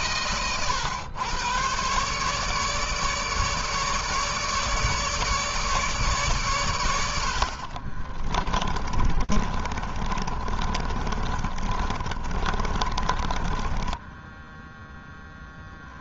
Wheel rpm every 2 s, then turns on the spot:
120, 150, 150, 130, 30, 30, 30, 10.
8-16